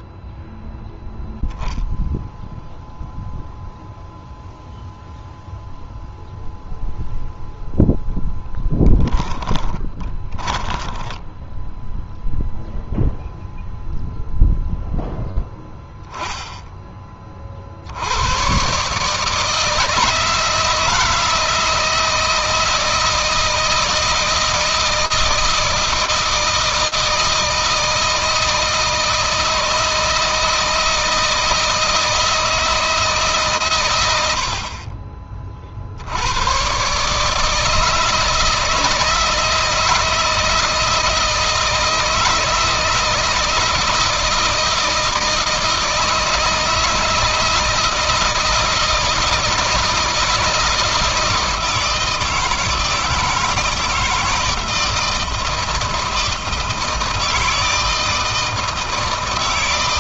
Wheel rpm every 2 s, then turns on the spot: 0, 0, 0, 0, 10, 10, 0, 0, 20, 140, 160, 160, 160, 160, 160, 160, 160, 40, 140, 160, 160, 160, 160, 160, 160, 160, 160, 160, 160, 160.
8-12